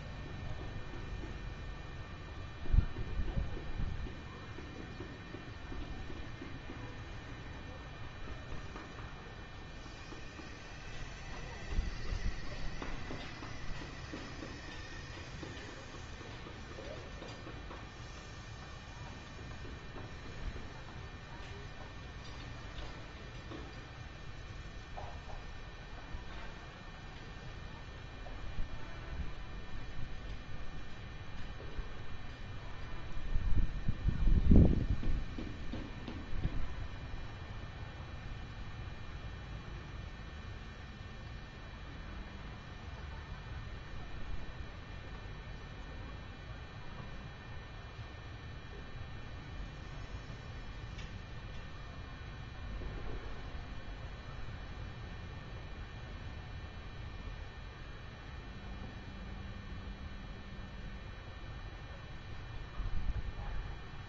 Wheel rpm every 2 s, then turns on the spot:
0, 0, 0, 0, 0, 0, 0, 0, 0, 0, 0, 0, 0, 0, 0, 0, 0, 0, 0, 0, 0, 0, 0, 0, 0, 0, 0, 0, 0, 0, 0, 0.
none